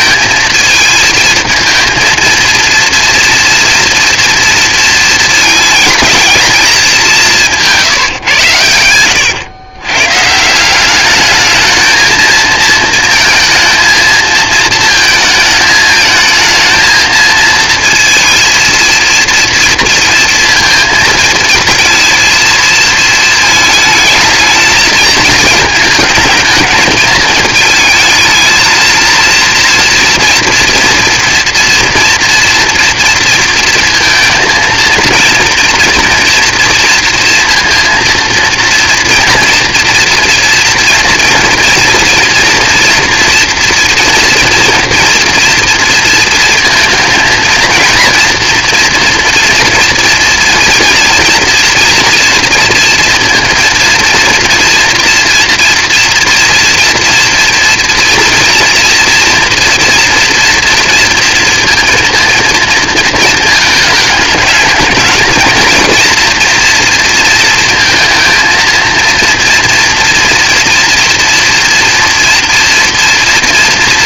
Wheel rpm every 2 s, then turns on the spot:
220, 230, 230, 220, 100, 170, 230, 220, 220, 230, 230, 230, 220, 220, 230, 240, 230, 230, 230, 230, 230, 230, 230, 230, 230, 230, 230, 230, 230, 230, 230, 220, 220, 230, 230, 230, 230.
none